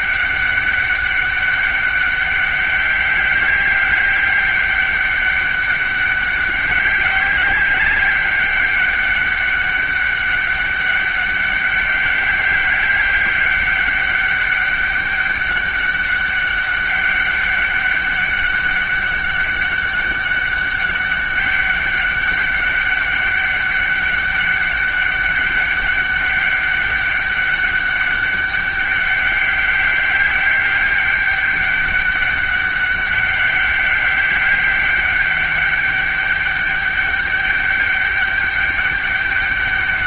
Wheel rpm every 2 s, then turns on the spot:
200, 200, 200, 190, 200, 200, 200, 200, 200, 200, 200, 200, 200, 200, 200, 200, 200, 200, 200, 200.
none